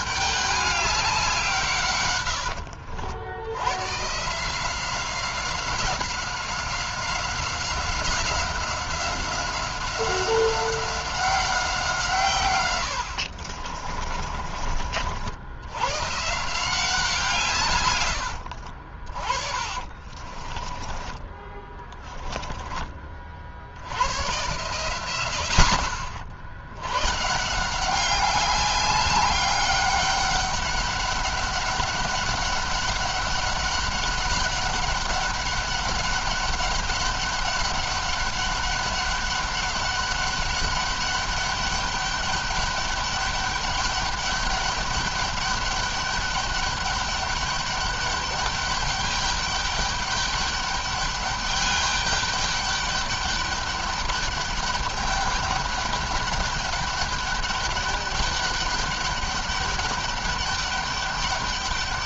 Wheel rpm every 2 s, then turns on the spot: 200, 80, 180, 190, 190, 190, 100, 50, 160, 40, 20, 30, 110, 110, 200, 200, 200, 200, 200, 200, 200, 200, 200, 200, 200, 200, 200, 200, 200, 200, 200.
12-14 18-22